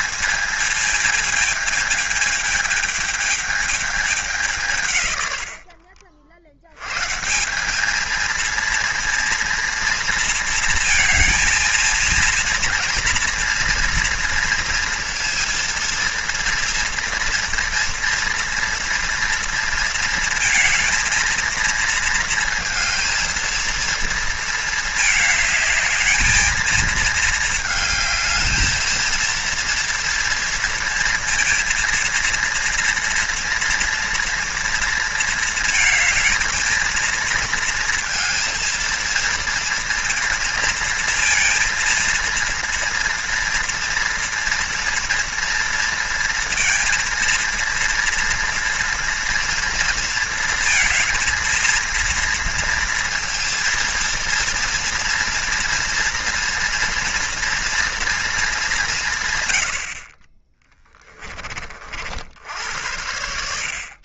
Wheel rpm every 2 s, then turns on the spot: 220, 220, 140, 100, 230, 220, 230, 230, 230, 230, 220, 230, 220, 220, 220, 230, 230, 230, 220, 230, 230, 230, 240, 230, 230, 230, 230, 230, 230, 190, 20, 80.
60-62